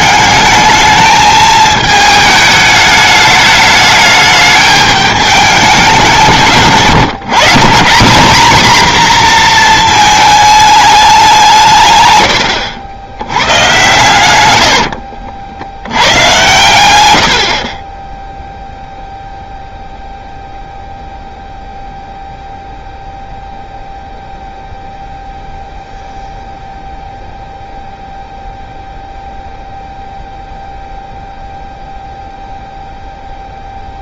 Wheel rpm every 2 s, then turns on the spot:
210, 210, 210, 170, 250, 220, 90, 100, 110, 0, 0, 0, 0, 0, 0, 0, 0.
14-16